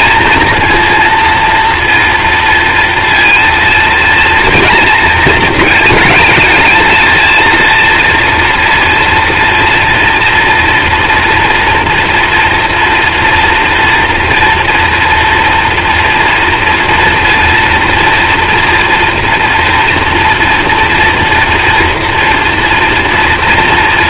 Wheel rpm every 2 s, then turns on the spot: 230, 230, 220, 220, 230, 240, 230, 230, 230, 230, 230, 240.
none